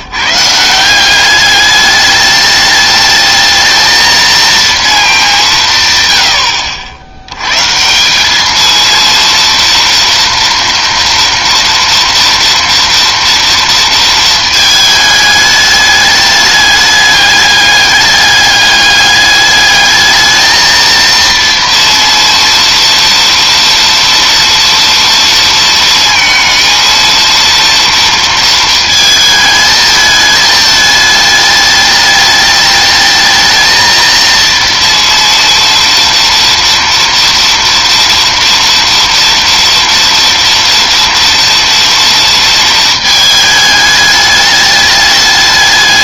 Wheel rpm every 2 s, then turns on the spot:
150, 210, 230, 120, 200, 230, 230, 230, 210, 200, 220, 230, 230, 230, 230, 220, 210, 230, 230, 230, 230, 230, 210.
none